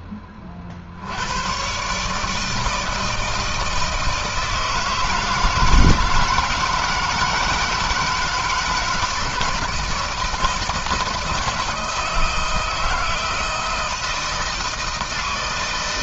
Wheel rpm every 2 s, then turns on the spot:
40, 160, 160, 160, 160, 160, 160, 160.
none